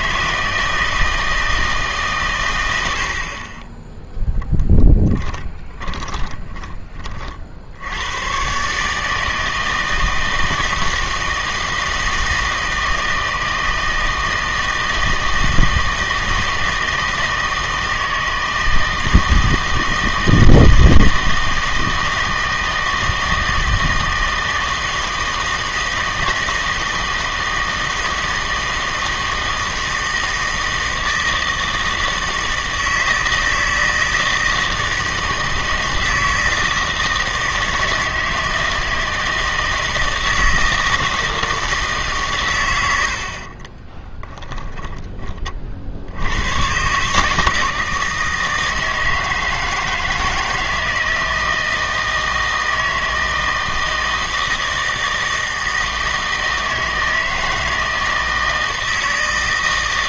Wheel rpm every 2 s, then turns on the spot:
160, 90, 10, 20, 140, 160, 160, 160, 160, 160, 160, 160, 160, 160, 160, 160, 160, 160, 160, 160, 160, 110, 10, 110, 160, 160, 160, 160, 160, 160.
4-6 44-46